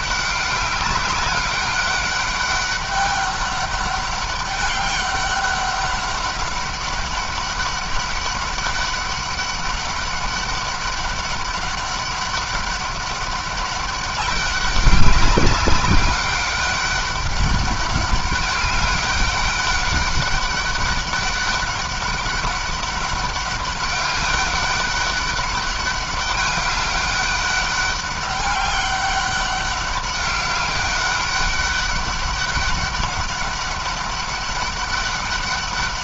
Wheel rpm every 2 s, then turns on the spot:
200, 200, 200, 200, 200, 200, 200, 200, 200, 200, 200, 200, 200, 200, 200, 200, 200, 190.
none